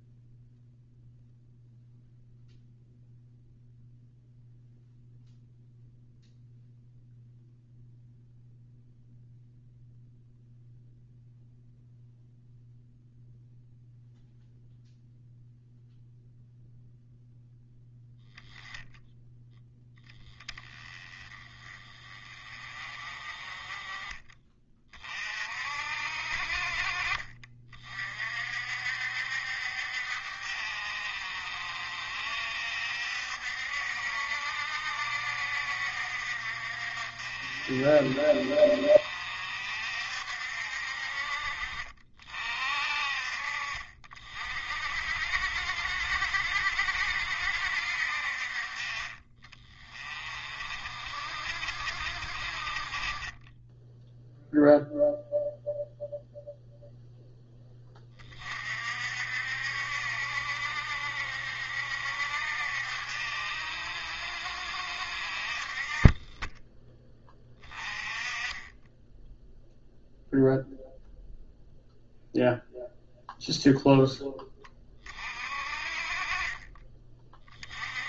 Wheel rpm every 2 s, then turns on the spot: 0, 0, 0, 0, 0, 0, 0, 0, 0, 0, 30, 30, 30, 40, 60, 60, 60, 70, 60, 60, 50, 40, 50, 60, 40, 50, 40, 0, 0, 50, 60, 60, 60, 10, 10, 0, 0, 20, 20.
none